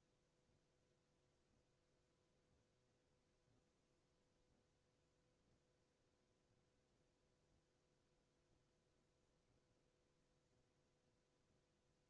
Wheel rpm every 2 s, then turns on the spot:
0, 0, 0, 0, 0, 0.
none